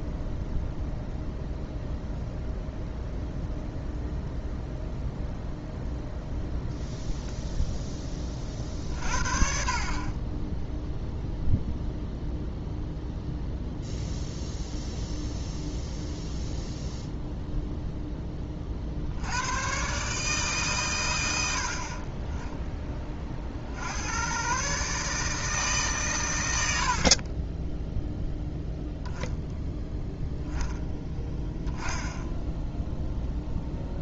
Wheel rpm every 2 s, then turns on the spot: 0, 0, 0, 0, 40, 10, 0, 0, 0, 30, 140, 20, 130, 90, 0, 10, 0.
none